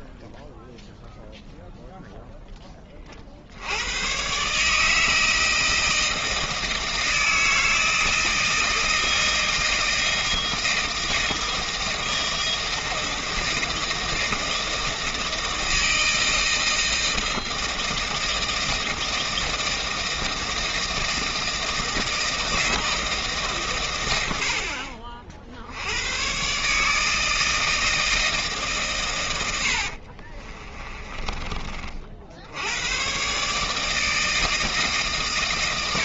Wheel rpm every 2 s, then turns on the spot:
0, 30, 160, 160, 160, 160, 160, 160, 160, 160, 160, 160, 50, 150, 120, 20, 120, 140.
30-32